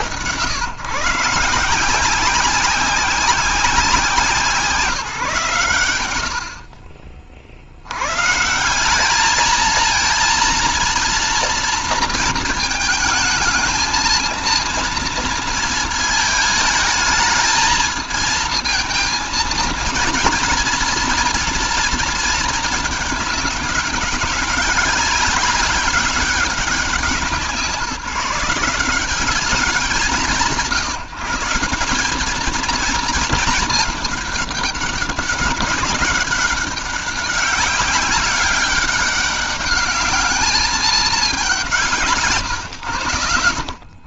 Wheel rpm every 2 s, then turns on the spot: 100, 180, 180, 80, 140, 230, 230, 220, 220, 230, 230, 220, 200, 200, 180, 160, 200, 210, 200, 190, 210, 130.
none